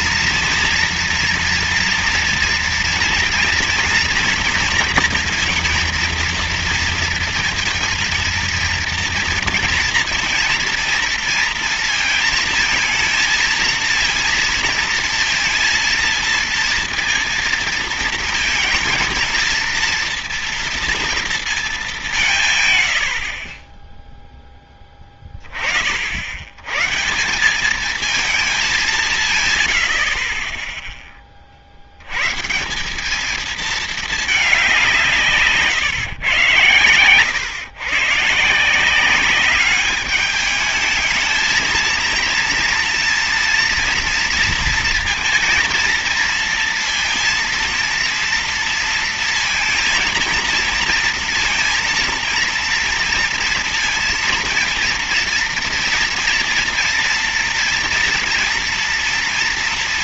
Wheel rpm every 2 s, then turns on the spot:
230, 230, 230, 230, 230, 230, 220, 230, 230, 230, 230, 140, 10, 110, 200, 10, 160, 200, 120, 170, 210, 230, 230, 230, 230, 230, 230, 230, 230, 230.
none